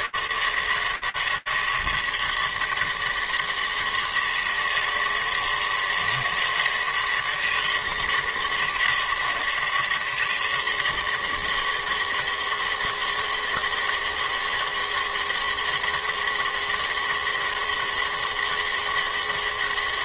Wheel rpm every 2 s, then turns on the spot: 150, 160, 160, 160, 160, 160, 160, 160, 160, 160.
none